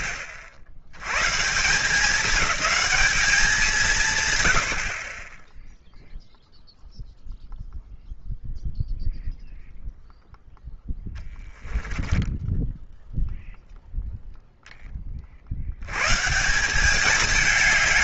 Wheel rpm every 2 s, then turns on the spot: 80, 210, 10, 0, 0, 0, 0, 40, 210.
none